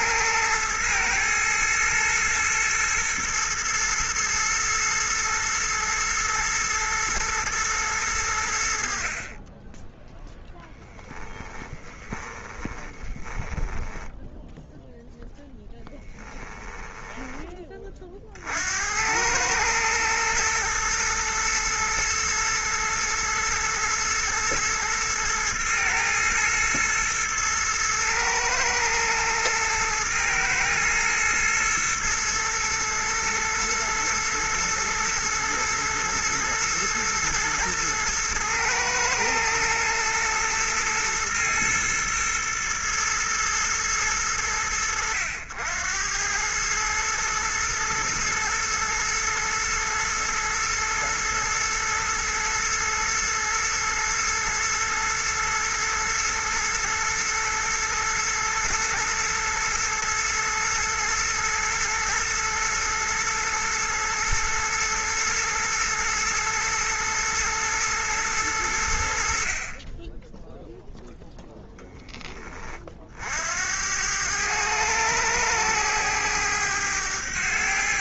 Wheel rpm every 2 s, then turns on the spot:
110, 120, 120, 110, 80, 10, 20, 0, 10, 70, 110, 110, 110, 110, 110, 110, 110, 110, 110, 110, 110, 110, 90, 110, 110, 110, 110, 120, 110, 110, 110, 120, 120, 120, 90, 0, 30, 100, 100.
12-14 16-18